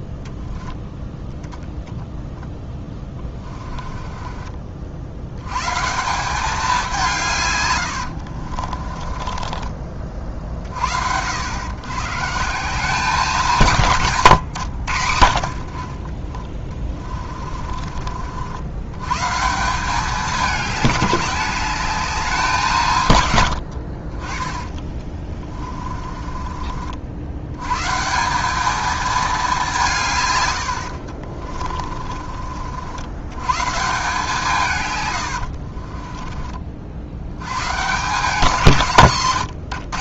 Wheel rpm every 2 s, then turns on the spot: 0, 10, 50, 190, 40, 70, 190, 90, 20, 120, 200, 150, 20, 60, 220, 70, 80, 130, 60, 170.
2-4 8-10 16-18 24-26 30-32